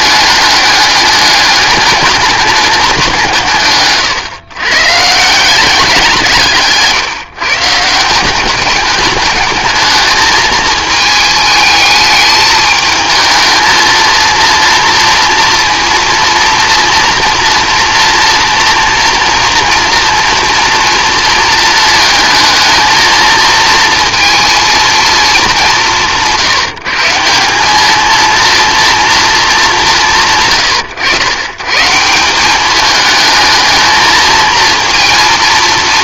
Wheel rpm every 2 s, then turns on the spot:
210, 200, 140, 150, 200, 220, 220, 230, 240, 230, 230, 220, 230, 160, 230, 120, 210, 230.
6-8